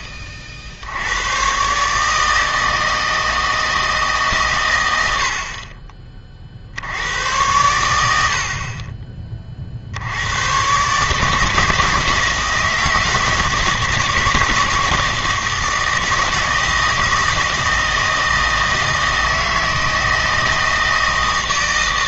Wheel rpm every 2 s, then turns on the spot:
60, 160, 100, 60, 40, 130, 160, 160, 160, 160, 160.
none